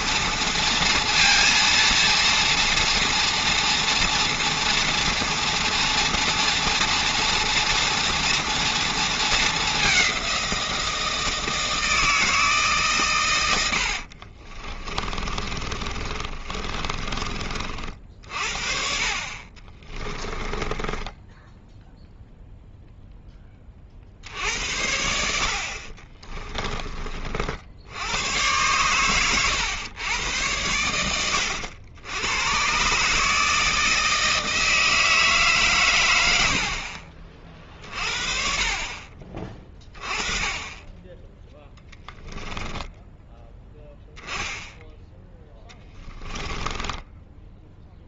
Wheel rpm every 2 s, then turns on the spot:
230, 230, 230, 240, 230, 170, 140, 30, 30, 50, 20, 0, 70, 20, 120, 90, 130, 160, 50, 40, 20, 10, 10, 10.
14-18 20-22 36-38 42-44 46-48